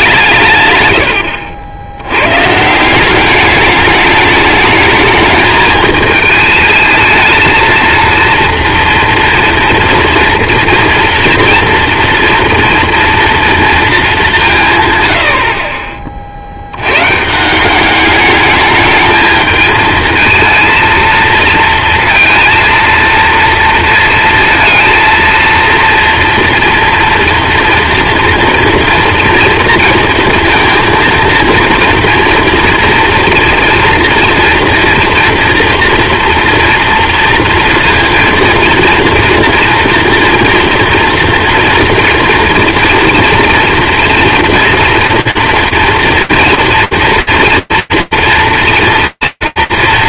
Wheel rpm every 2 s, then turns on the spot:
90, 190, 210, 230, 240, 230, 230, 100, 110, 210, 220, 230, 230, 230, 230, 230, 230, 230, 230, 230, 230, 240, 230, 230, 230.
none